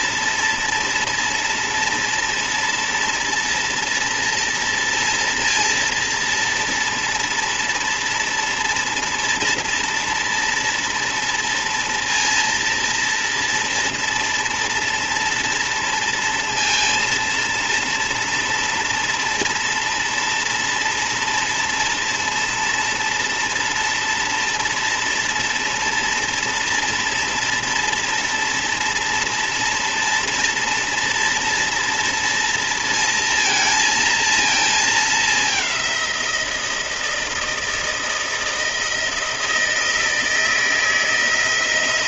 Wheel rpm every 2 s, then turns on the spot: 240, 230, 230, 230, 230, 230, 230, 230, 230, 230, 230, 240, 230, 230, 230, 230, 220, 220, 160, 160, 160.
none